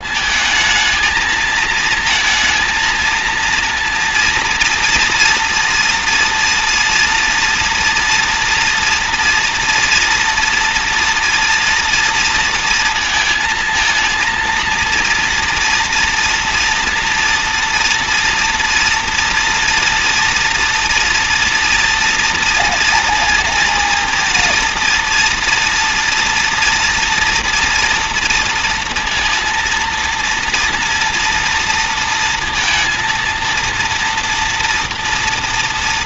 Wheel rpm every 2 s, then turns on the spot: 220, 220, 240, 230, 230, 230, 230, 230, 230, 230, 230, 230, 230, 230, 230, 230, 230, 230.
none